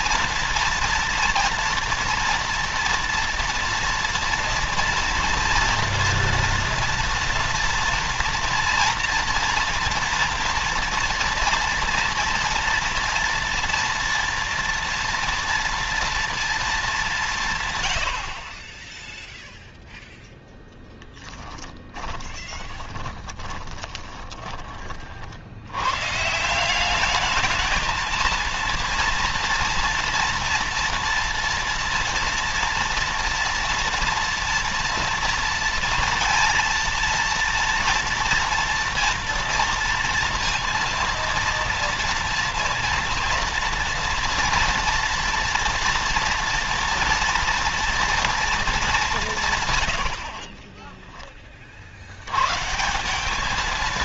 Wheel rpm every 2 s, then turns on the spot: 230, 230, 230, 230, 230, 230, 230, 230, 230, 80, 10, 30, 20, 130, 220, 230, 230, 230, 230, 230, 230, 230, 230, 230, 230, 80, 80.
22-26